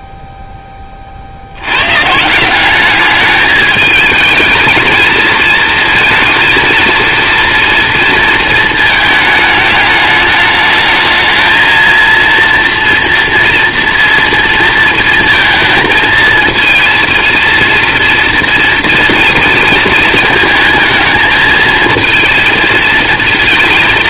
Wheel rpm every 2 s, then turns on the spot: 30, 210, 220, 230, 220, 220, 230, 230, 230, 230, 220, 220.
none